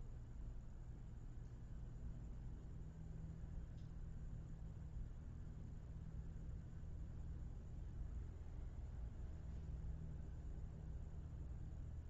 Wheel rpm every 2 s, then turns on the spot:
0, 0, 0, 0, 0, 0.
none